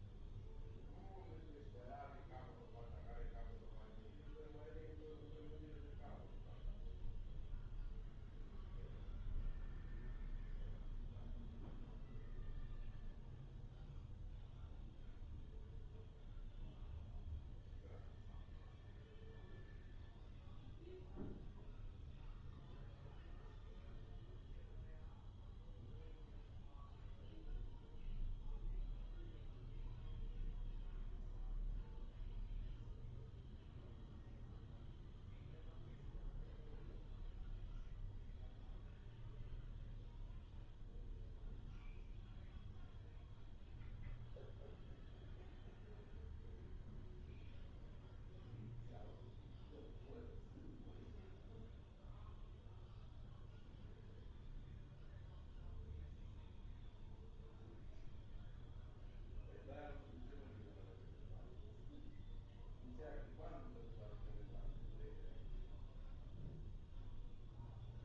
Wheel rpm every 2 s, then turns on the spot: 0, 0, 0, 0, 0, 0, 0, 0, 0, 0, 0, 0, 0, 0, 0, 0, 0, 0, 0, 0, 0, 0, 0, 0, 0, 0, 0, 0, 0, 0, 0, 0, 0, 0.
none